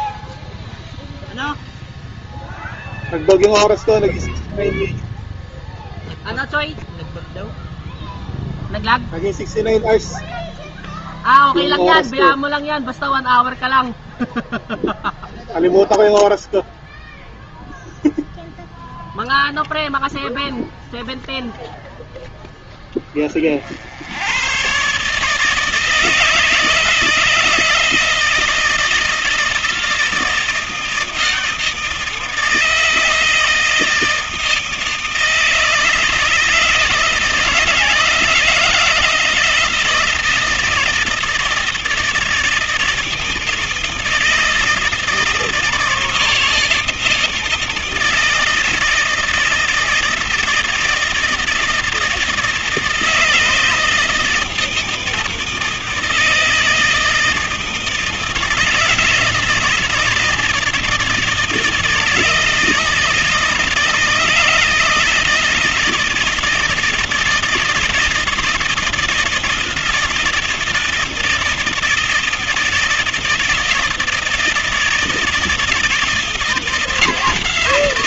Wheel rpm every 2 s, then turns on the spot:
0, 0, 0, 0, 0, 0, 0, 0, 0, 10, 0, 10, 120, 160, 160, 160, 160, 160, 160, 160, 160, 160, 160, 170, 160, 160, 160, 160, 160, 160, 160, 160, 160, 160, 160, 160, 160, 160, 160.
none